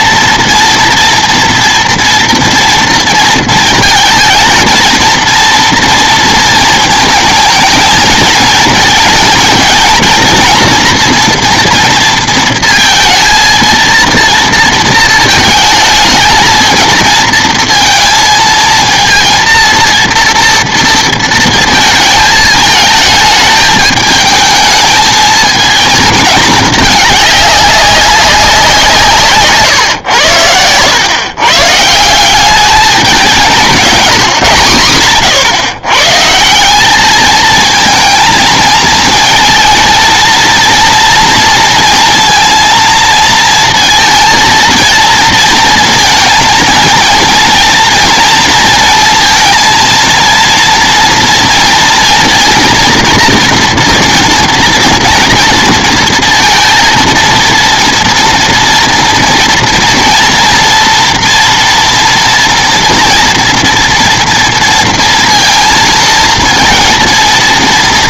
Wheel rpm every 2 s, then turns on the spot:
240, 230, 230, 230, 220, 230, 230, 220, 220, 230, 230, 220, 220, 210, 190, 100, 200, 120, 180, 220, 230, 230, 230, 230, 230, 230, 230, 230, 230, 240, 230, 230, 230, 230.
none